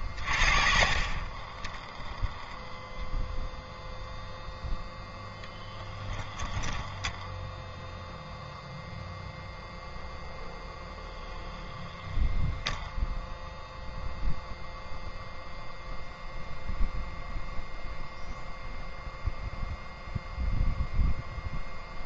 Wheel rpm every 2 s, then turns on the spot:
20, 0, 0, 0, 0, 0, 0, 0, 0, 0, 0.
none